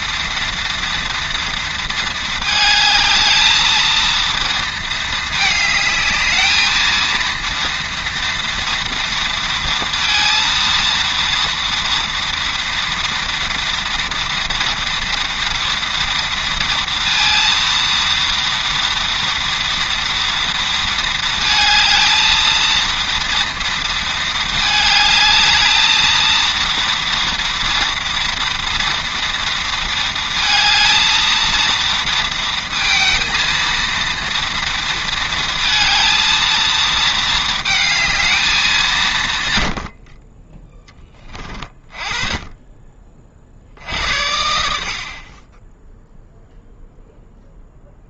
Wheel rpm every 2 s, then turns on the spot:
230, 220, 220, 220, 230, 230, 230, 230, 230, 230, 230, 230, 220, 230, 230, 220, 230, 230, 220, 180, 10, 30, 60, 0.
none